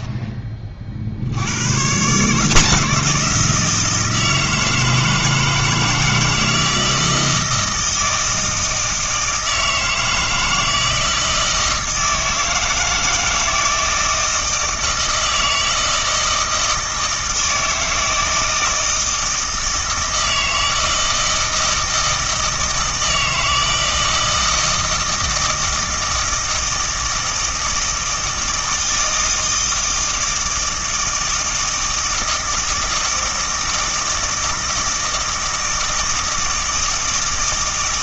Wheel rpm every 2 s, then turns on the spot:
40, 170, 160, 160, 160, 160, 160, 160, 160, 160, 160, 160, 160, 160, 160, 160, 160, 160, 160.
none